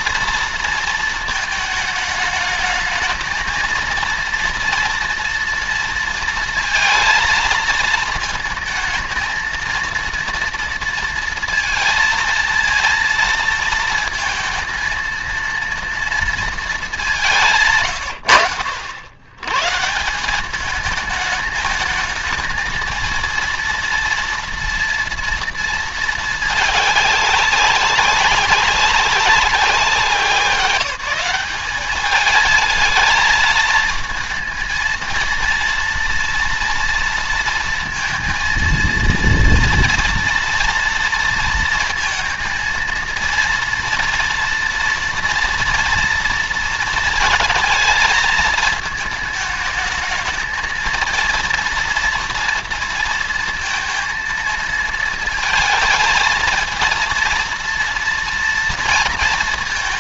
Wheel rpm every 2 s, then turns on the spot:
230, 210, 230, 230, 220, 230, 230, 230, 230, 90, 170, 220, 230, 220, 200, 190, 220, 230, 230, 230, 230, 230, 230, 230, 220, 220, 230, 230, 220, 230.
none